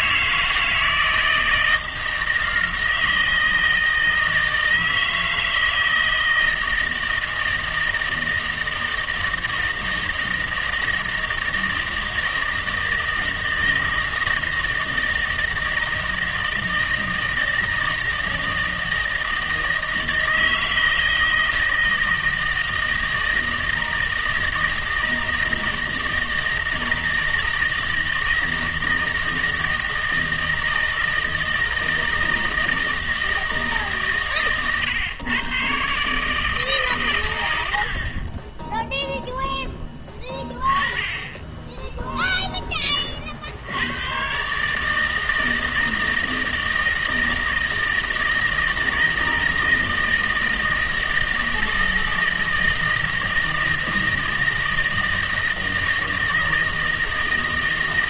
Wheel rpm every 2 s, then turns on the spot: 160, 160, 160, 160, 160, 160, 160, 160, 160, 160, 160, 160, 160, 160, 160, 160, 160, 130, 140, 10, 10, 20, 150, 160, 160, 160, 160, 160, 160.
none